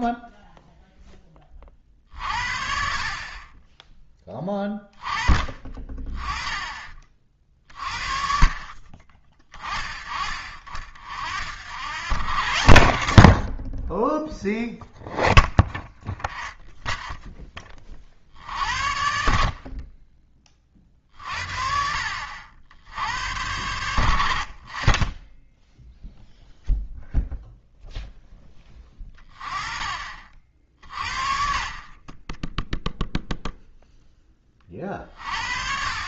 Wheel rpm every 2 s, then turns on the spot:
0, 40, 20, 30, 40, 50, 90, 0, 0, 60, 40, 80, 30, 0, 10, 50, 0, 40.
none